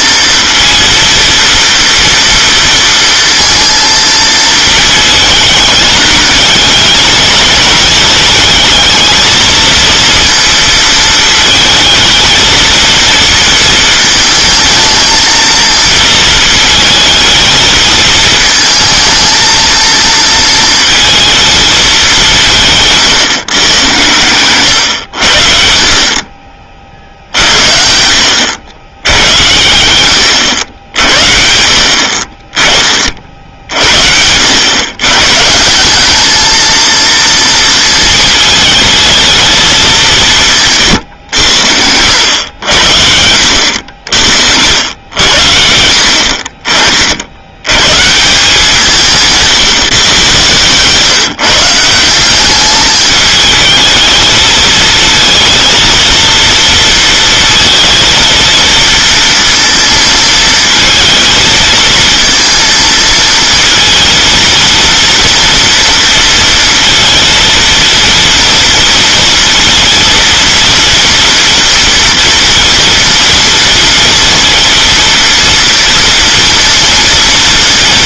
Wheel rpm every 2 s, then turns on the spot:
230, 230, 220, 210, 220, 230, 220, 220, 220, 220, 230, 170, 110, 40, 90, 80, 30, 90, 220, 220, 150, 90, 70, 50, 170, 140, 200, 220, 230, 230, 220, 230, 230, 230, 230, 230, 230, 230, 230.
none